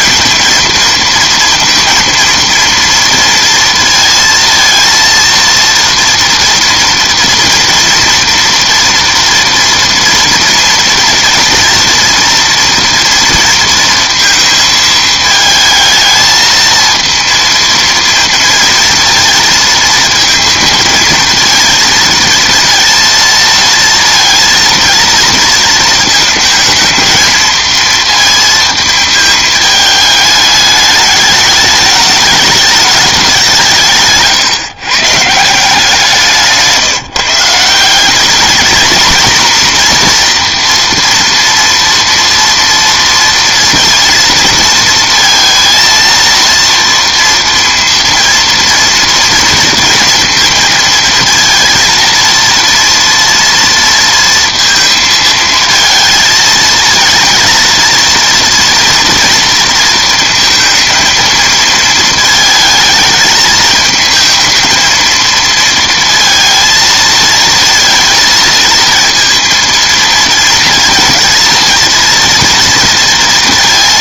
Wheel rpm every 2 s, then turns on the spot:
230, 230, 230, 230, 230, 230, 230, 220, 230, 230, 220, 230, 230, 230, 220, 210, 210, 150, 170, 220, 230, 230, 230, 230, 230, 230, 230, 230, 220, 240, 230, 220, 220, 230, 220, 230, 230.
none